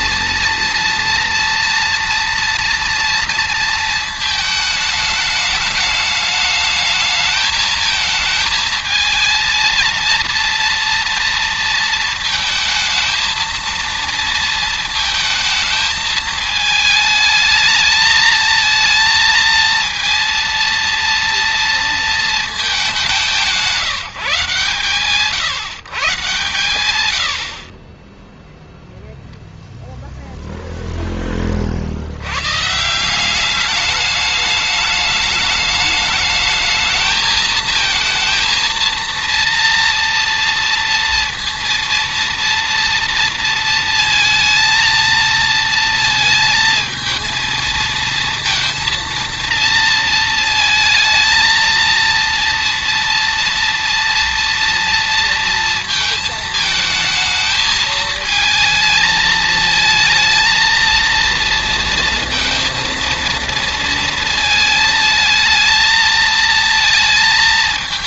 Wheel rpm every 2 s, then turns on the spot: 230, 230, 210, 220, 230, 230, 230, 220, 220, 230, 230, 170, 140, 30, 0, 40, 210, 210, 220, 230, 230, 230, 230, 230, 230, 230, 230, 230, 220, 220, 230, 230, 220, 220.
none